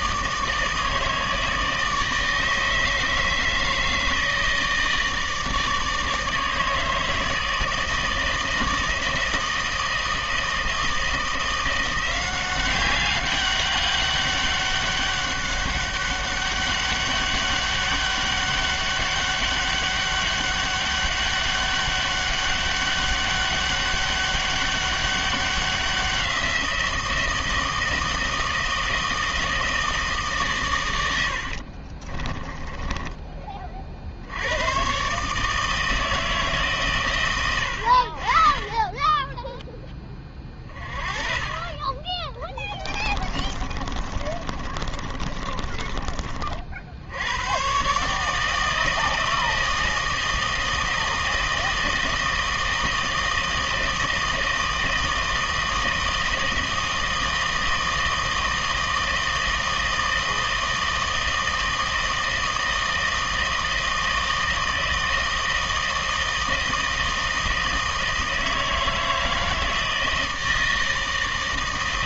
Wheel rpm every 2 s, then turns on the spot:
160, 160, 160, 160, 160, 160, 190, 200, 200, 200, 200, 200, 200, 170, 160, 130, 10, 110, 140, 30, 30, 20, 30, 60, 160, 160, 160, 160, 160, 160, 160, 160, 160, 160, 160, 160.
32-34 42-46